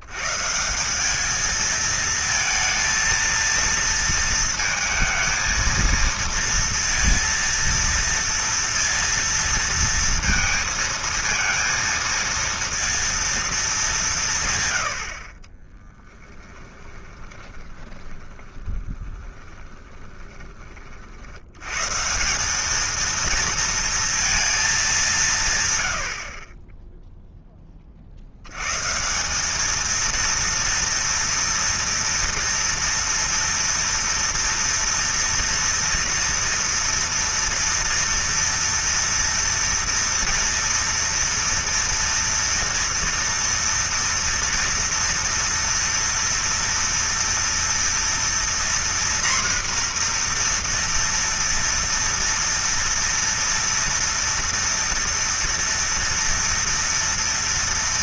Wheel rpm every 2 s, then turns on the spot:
190, 230, 220, 230, 230, 230, 230, 70, 10, 10, 30, 210, 200, 10, 140, 230, 230, 230, 230, 230, 230, 230, 230, 230, 240, 240, 230, 230, 230.
16-20